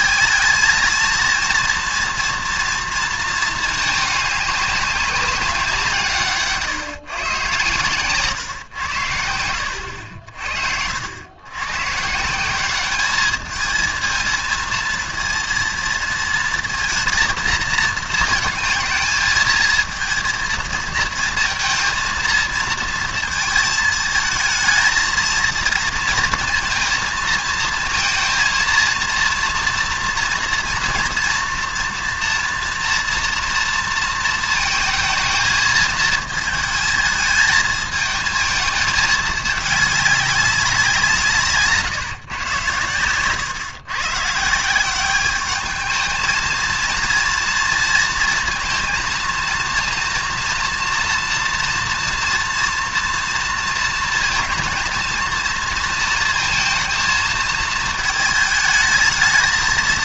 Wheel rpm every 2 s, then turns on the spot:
220, 230, 200, 140, 110, 60, 200, 230, 230, 220, 230, 230, 220, 230, 230, 230, 230, 220, 220, 220, 190, 120, 160, 230, 230, 230, 230, 230, 230, 220.
none